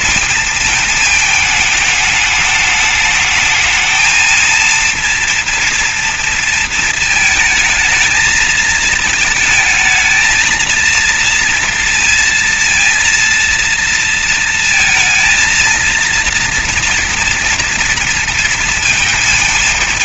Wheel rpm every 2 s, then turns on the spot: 220, 210, 230, 220, 220, 230, 230, 220, 230, 230.
none